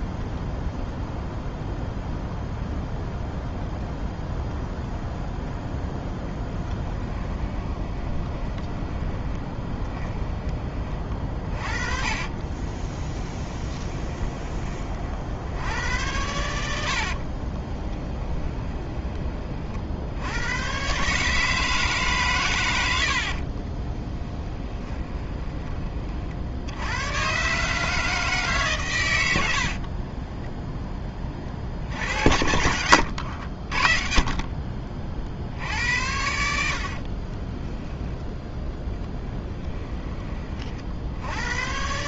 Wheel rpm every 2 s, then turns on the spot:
0, 0, 0, 10, 20, 30, 30, 20, 80, 20, 110, 110, 20, 80, 140, 10, 80, 40, 70, 10, 40.
6-10 12-14 16-20 24-26 32-34 36-38